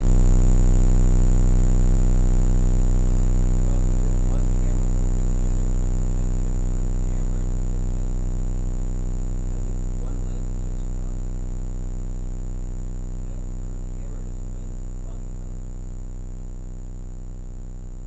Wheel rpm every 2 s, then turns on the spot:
0, 0, 0, 0, 0, 0, 0, 0, 0.
none